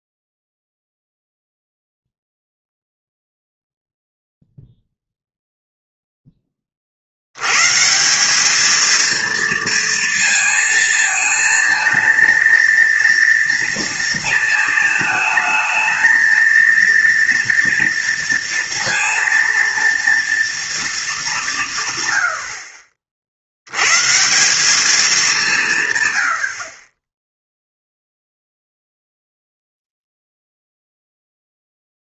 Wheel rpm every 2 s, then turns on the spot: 0, 0, 0, 30, 220, 230, 230, 220, 230, 230, 230, 50, 190, 60, 0, 0.
none